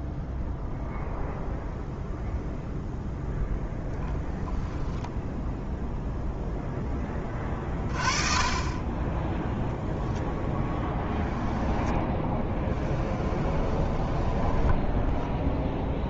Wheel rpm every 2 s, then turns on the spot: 0, 0, 10, 10, 20, 0, 10, 20.
12-16